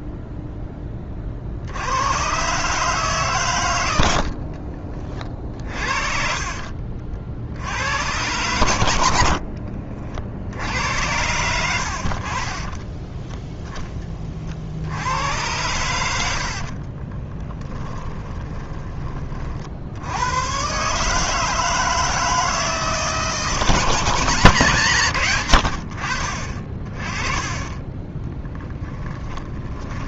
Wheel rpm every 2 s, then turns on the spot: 20, 140, 40, 50, 80, 80, 20, 60, 40, 20, 130, 160, 150, 30, 10.
4-6 12-14 16-20 28-30